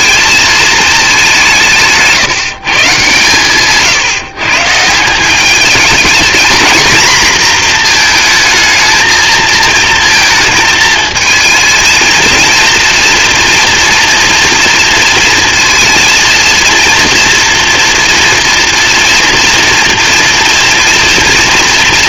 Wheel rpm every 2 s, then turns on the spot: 220, 140, 160, 240, 220, 220, 230, 230, 230, 230, 230.
none